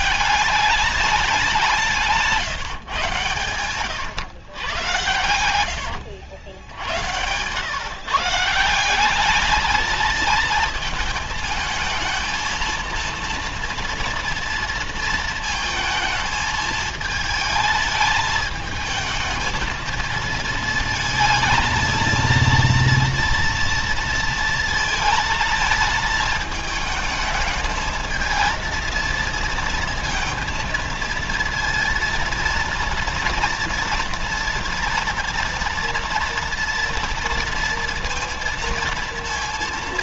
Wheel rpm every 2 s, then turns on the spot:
200, 130, 100, 90, 190, 220, 230, 230, 220, 220, 220, 230, 230, 220, 230, 230, 230, 230, 230, 230.
4-6